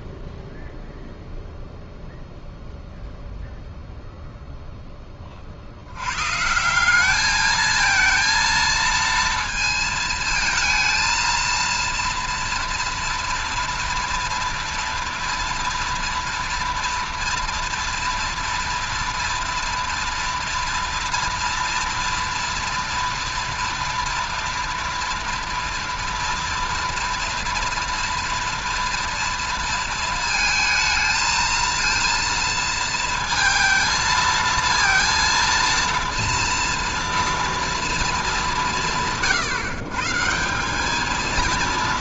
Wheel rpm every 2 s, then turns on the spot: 0, 0, 110, 230, 230, 230, 230, 230, 230, 230, 230, 230, 230, 230, 230, 230, 230, 230, 230, 130, 220.
none